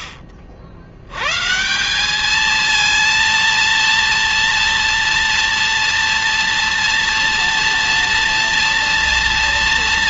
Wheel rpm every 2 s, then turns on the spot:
70, 230, 230, 230, 230.
none